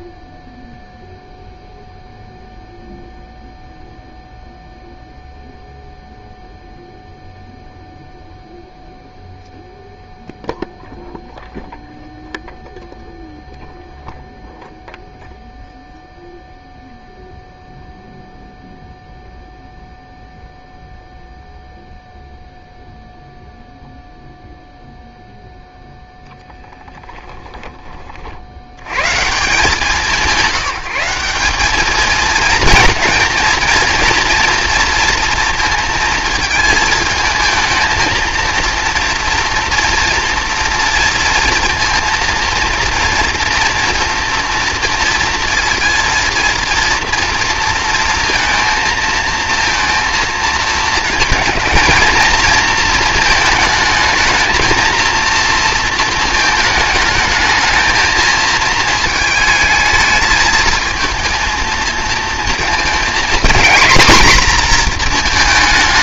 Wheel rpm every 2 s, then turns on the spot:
0, 0, 0, 0, 0, 0, 0, 0, 0, 0, 0, 0, 0, 10, 110, 190, 230, 230, 220, 230, 230, 230, 230, 230, 230, 230, 230, 230, 210, 220, 220, 230, 240.
26-28